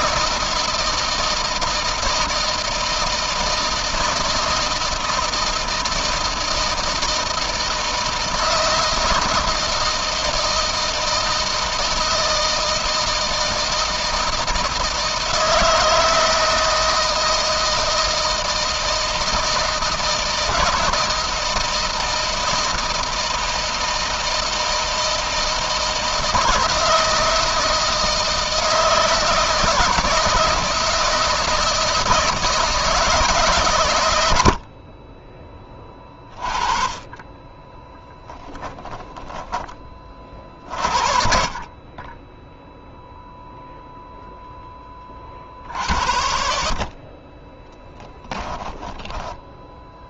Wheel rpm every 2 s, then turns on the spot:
160, 160, 160, 160, 160, 160, 160, 160, 160, 160, 160, 160, 160, 160, 160, 160, 150, 30, 20, 10, 40, 0, 40, 40, 10.
38-40 46-50